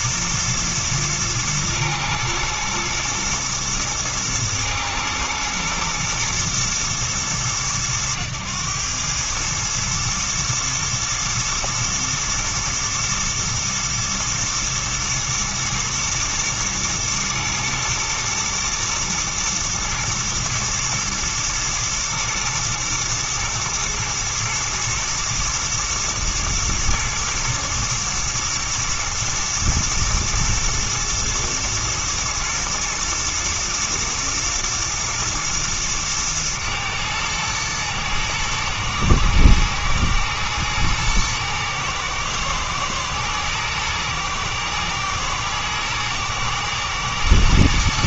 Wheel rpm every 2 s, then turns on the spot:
110, 110, 120, 110, 100, 110, 120, 110, 120, 110, 110, 110, 120, 110, 110, 120, 120, 120, 110, 110, 110, 110, 120, 110.
none